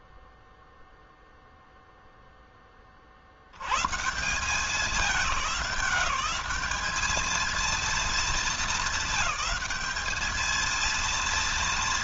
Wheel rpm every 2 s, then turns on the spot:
0, 40, 190, 210, 220, 230.
none